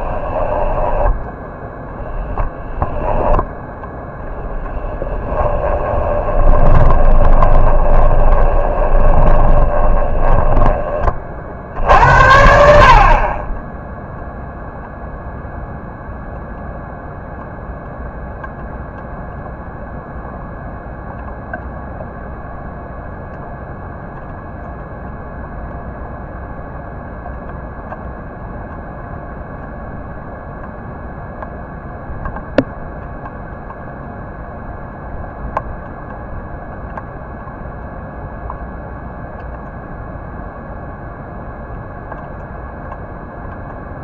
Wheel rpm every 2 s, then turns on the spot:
10, 0, 10, 20, 20, 20, 50, 0, 0, 0, 0, 0, 0, 0, 0, 0, 0, 0, 0, 0, 0, 0.
0-2 4-12